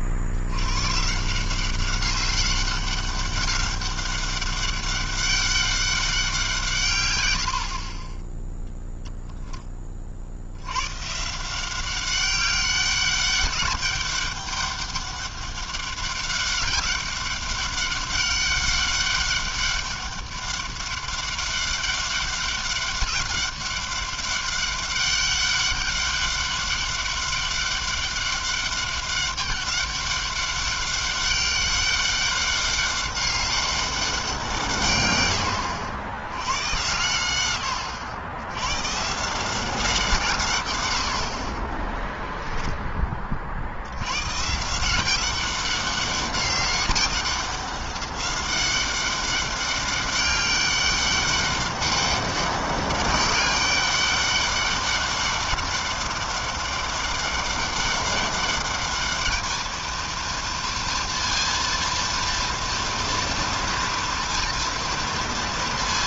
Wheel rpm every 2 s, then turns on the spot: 90, 200, 200, 180, 0, 100, 200, 200, 200, 200, 200, 200, 200, 200, 200, 200, 200, 110, 110, 180, 40, 90, 190, 190, 200, 200, 200, 200, 200, 220, 230, 230, 230.
none